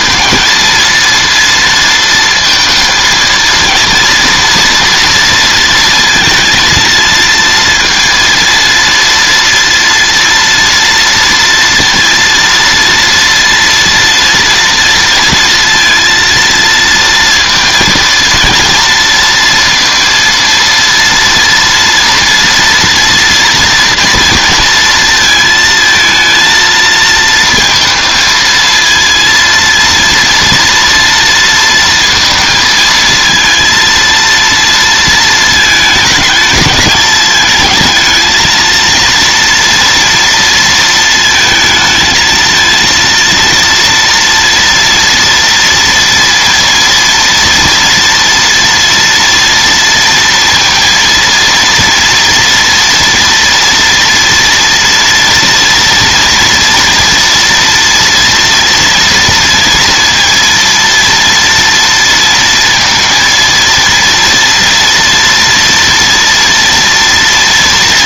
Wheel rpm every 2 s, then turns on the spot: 230, 230, 230, 230, 230, 230, 230, 230, 230, 230, 230, 230, 230, 220, 230, 230, 230, 230, 210, 230, 230, 230, 230, 230, 230, 230, 230, 230, 230, 230, 230, 230, 230, 230.
none